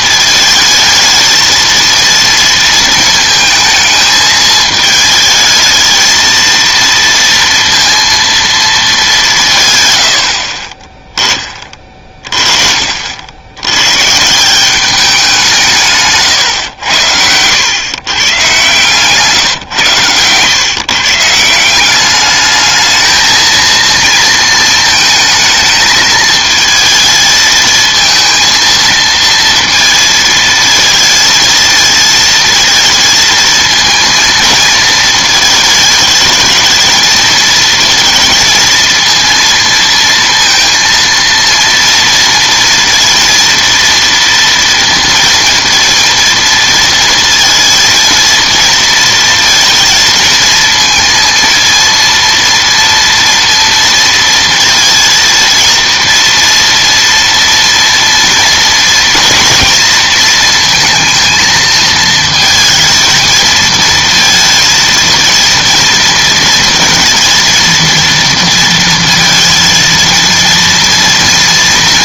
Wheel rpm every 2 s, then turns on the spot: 220, 230, 220, 230, 220, 30, 40, 180, 120, 140, 130, 220, 220, 220, 230, 220, 230, 220, 220, 230, 230, 230, 230, 230, 230, 230, 230, 230, 230, 240, 230, 230, 230, 230, 230, 230.
none